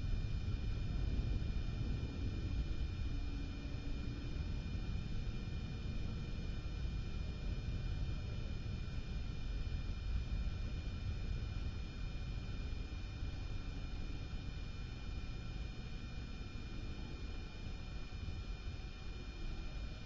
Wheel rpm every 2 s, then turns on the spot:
0, 0, 0, 0, 0, 0, 0, 0, 0, 0.
none